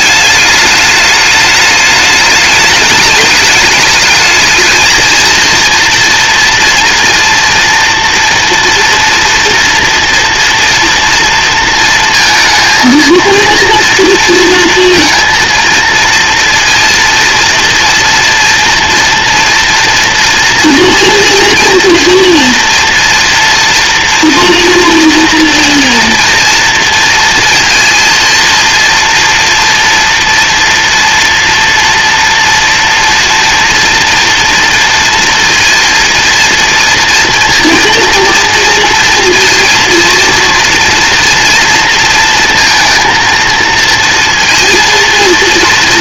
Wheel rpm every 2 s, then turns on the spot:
210, 210, 230, 230, 230, 230, 230, 230, 230, 240, 230, 240, 230, 230, 230, 230, 230, 230, 230, 230, 230, 230, 230.
none